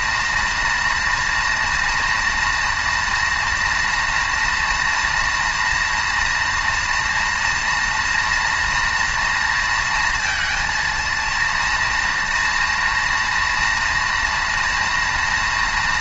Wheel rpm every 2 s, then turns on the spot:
240, 230, 230, 240, 230, 230, 230, 230.
none